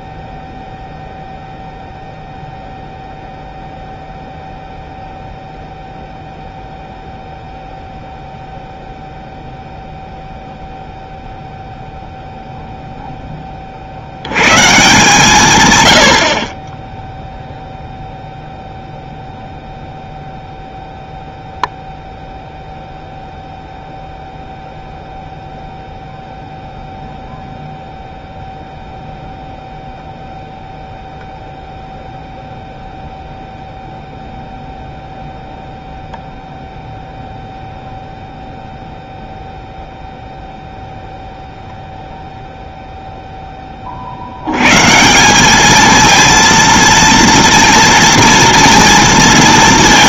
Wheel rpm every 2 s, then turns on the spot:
0, 0, 0, 0, 0, 0, 0, 140, 30, 0, 0, 0, 0, 0, 0, 0, 0, 0, 0, 0, 0, 0, 110, 230, 230.
none